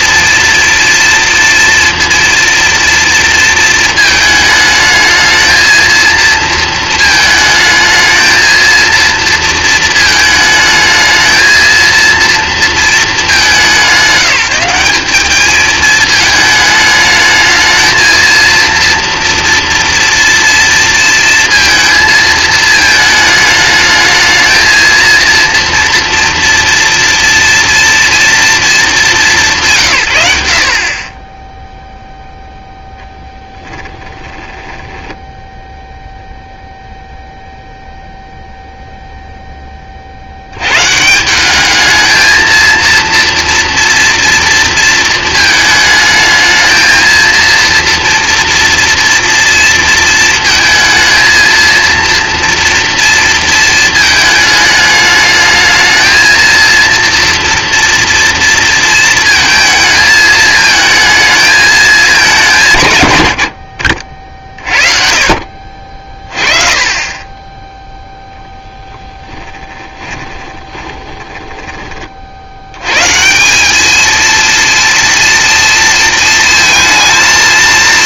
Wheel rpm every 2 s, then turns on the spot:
240, 230, 220, 220, 230, 220, 200, 200, 220, 230, 230, 220, 230, 240, 190, 40, 10, 10, 0, 0, 120, 230, 230, 220, 230, 220, 230, 210, 230, 230, 220, 150, 30, 30, 0, 20, 100, 230, 220.
30-36 70-72